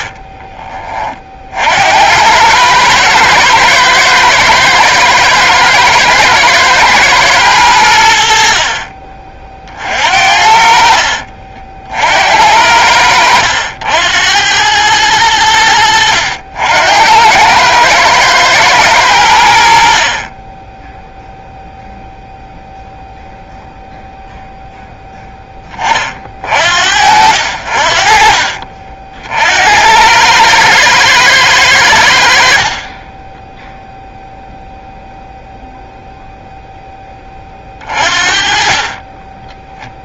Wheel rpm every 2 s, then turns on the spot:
20, 100, 110, 110, 50, 50, 80, 100, 80, 110, 10, 0, 0, 60, 50, 110, 40, 0, 0, 30.
12-14